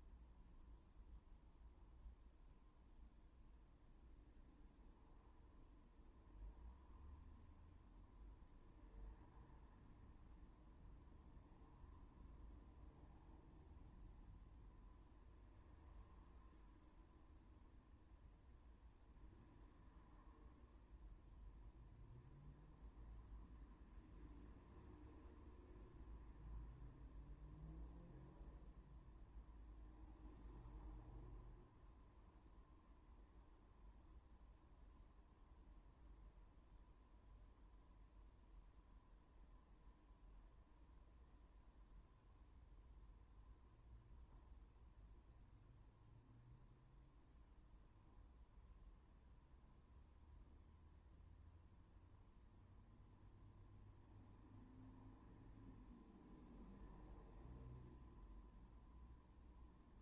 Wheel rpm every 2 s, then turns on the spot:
0, 0, 0, 0, 0, 0, 0, 0, 0, 0, 0, 0, 0, 0, 0, 0, 0, 0, 0, 0, 0, 0, 0, 0, 0, 0, 0, 0, 0, 0.
none